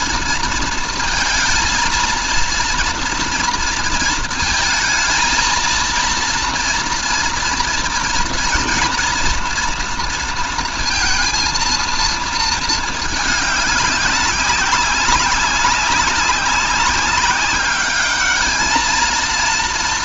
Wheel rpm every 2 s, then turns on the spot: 230, 230, 220, 230, 230, 230, 220, 190, 190, 220.
none